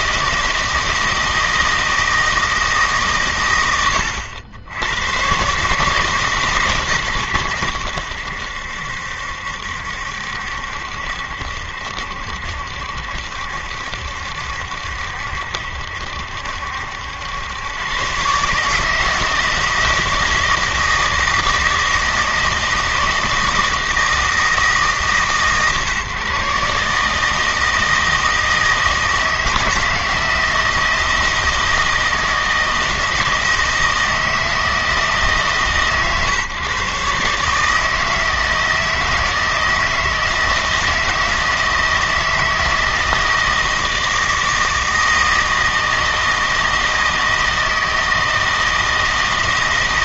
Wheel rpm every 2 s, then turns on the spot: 160, 160, 90, 140, 80, 70, 70, 70, 70, 140, 160, 160, 160, 140, 160, 160, 160, 160, 130, 160, 160, 160, 160, 160, 160.
none